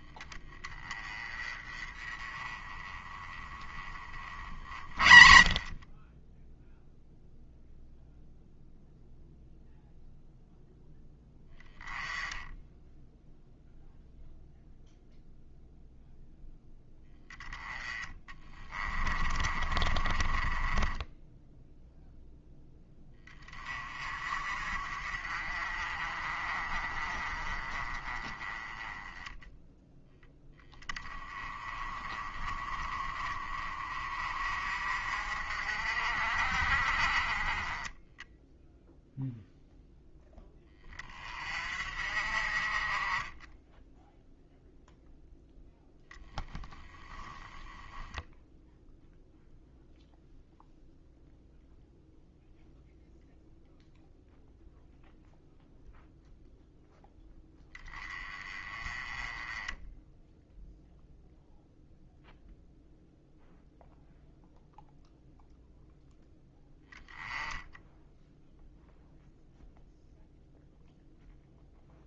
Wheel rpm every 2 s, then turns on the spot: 20, 20, 30, 0, 0, 0, 10, 0, 10, 20, 10, 10, 40, 30, 10, 10, 30, 50, 40, 0, 20, 30, 0, 10, 0, 0, 0, 0, 0, 20, 0, 0, 0, 0, 0, 0.
4-6 18-22 46-48